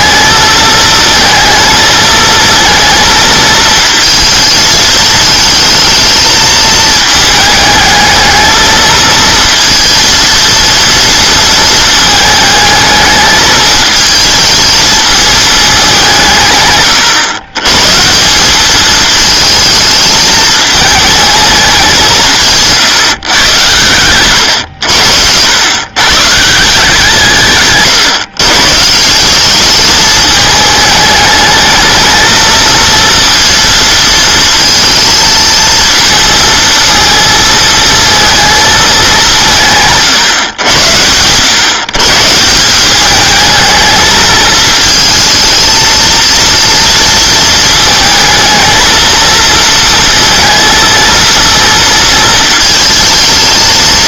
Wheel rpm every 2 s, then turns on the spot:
220, 230, 220, 220, 220, 230, 220, 220, 130, 210, 220, 160, 90, 160, 150, 210, 230, 230, 230, 210, 100, 180, 220, 230, 230, 230, 220.
none